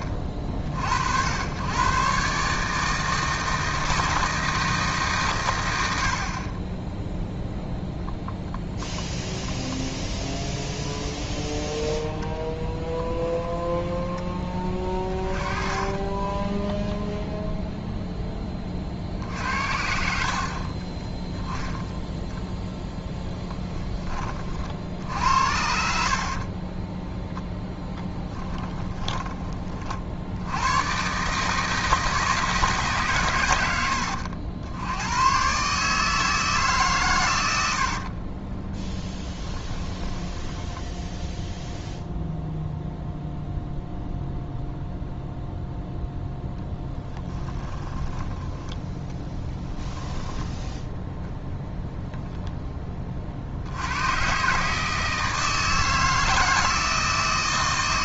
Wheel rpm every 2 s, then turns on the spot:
50, 150, 160, 10, 0, 10, 10, 20, 10, 40, 30, 10, 50, 20, 10, 100, 150, 90, 150, 10, 10, 0, 0, 10, 10, 10, 20, 150, 160.
10-18 22-24 26-30 38-42 46-50